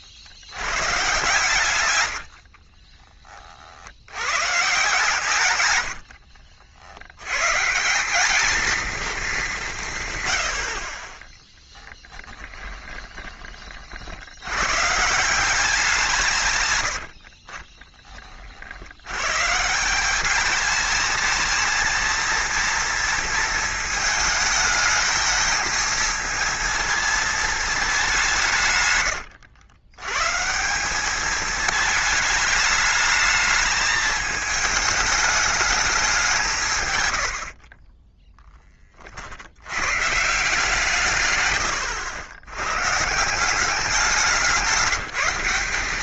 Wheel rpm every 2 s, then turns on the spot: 120, 30, 140, 70, 220, 40, 20, 130, 100, 70, 210, 230, 220, 230, 140, 180, 210, 210, 150, 30, 160, 130, 190.
2-4 12-14 16-18